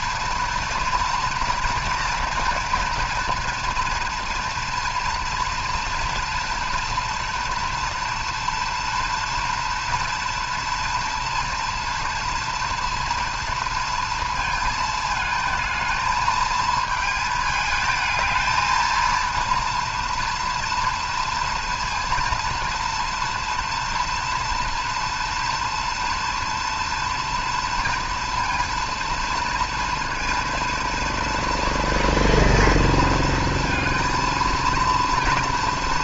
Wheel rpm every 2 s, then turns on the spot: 230, 230, 240, 230, 240, 230, 230, 230, 220, 220, 230, 240, 230, 230, 230, 230, 230, 230.
none